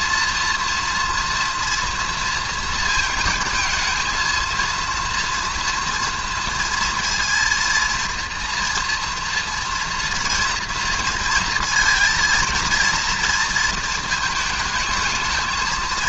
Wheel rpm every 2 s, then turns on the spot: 230, 230, 230, 230, 230, 230, 230, 220.
none